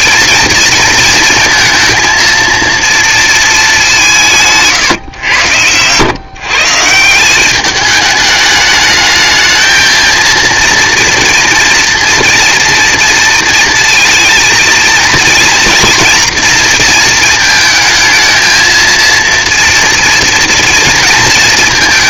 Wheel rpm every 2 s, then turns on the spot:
230, 230, 140, 140, 210, 230, 240, 220, 230, 220, 230.
none